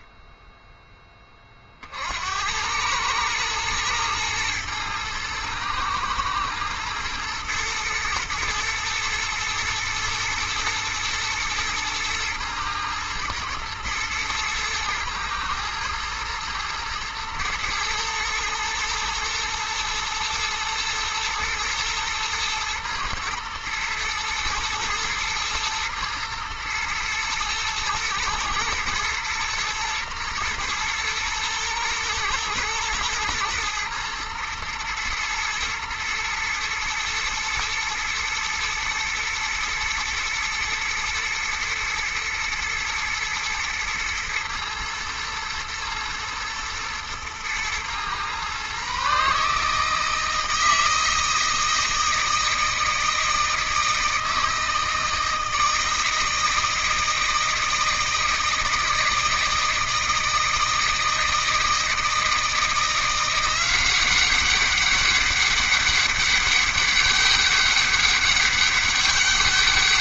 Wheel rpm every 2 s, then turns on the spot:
0, 90, 110, 110, 110, 110, 110, 110, 110, 110, 110, 120, 120, 110, 120, 120, 110, 120, 110, 120, 120, 120, 120, 120, 130, 160, 160, 160, 160, 160, 160, 160, 190, 200, 200.
none